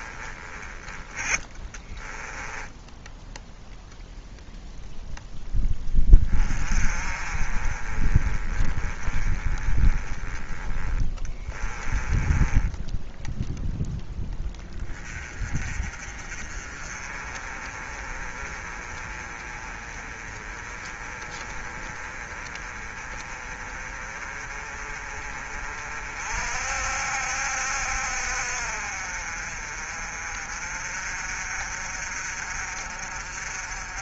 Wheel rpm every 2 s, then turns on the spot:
20, 10, 0, 30, 20, 20, 10, 20, 30, 30, 30, 30, 30, 60, 50, 40, 50.
2-4 12-14